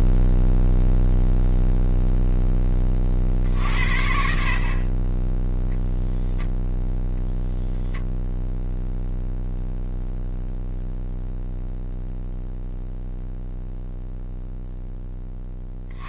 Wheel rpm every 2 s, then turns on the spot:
0, 10, 50, 0, 0, 0, 0, 0.
none